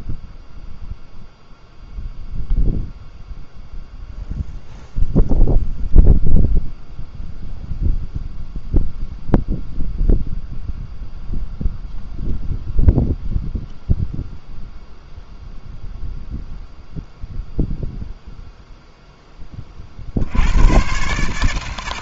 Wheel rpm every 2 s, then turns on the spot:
0, 0, 0, 0, 0, 0, 0, 0, 0, 0, 110.
none